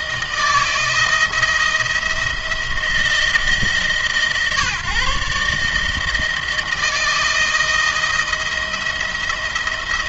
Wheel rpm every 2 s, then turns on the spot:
170, 170, 150, 160, 170.
none